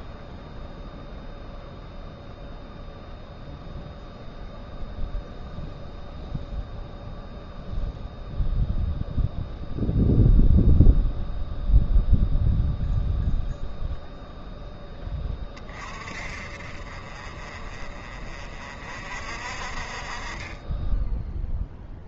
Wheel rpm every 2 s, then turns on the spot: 0, 0, 0, 0, 0, 0, 0, 0, 40, 40, 30.
none